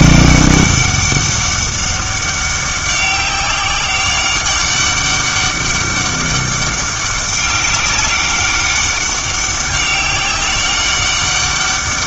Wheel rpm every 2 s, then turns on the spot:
200, 200, 190, 190, 190, 200.
none